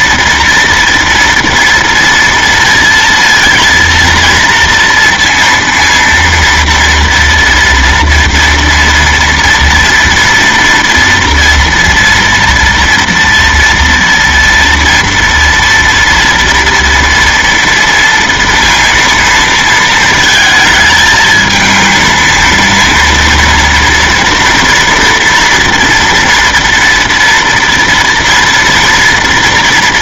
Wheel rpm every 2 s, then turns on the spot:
230, 230, 230, 230, 230, 230, 230, 230, 230, 230, 220, 230, 230, 230, 230.
none